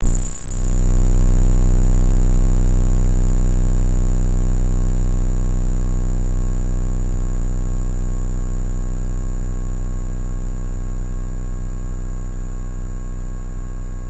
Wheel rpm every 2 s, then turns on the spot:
0, 0, 0, 0, 0, 0, 0.
none